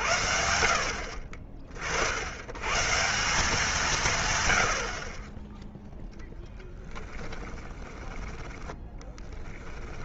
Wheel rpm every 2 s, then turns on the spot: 50, 150, 110, 10, 10.
8-10